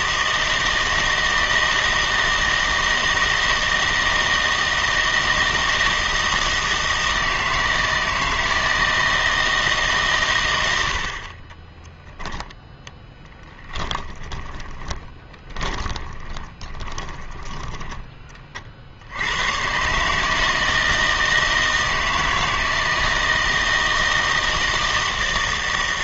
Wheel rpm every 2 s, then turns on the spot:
160, 160, 160, 160, 160, 90, 10, 30, 20, 40, 160, 160, 160.
12-18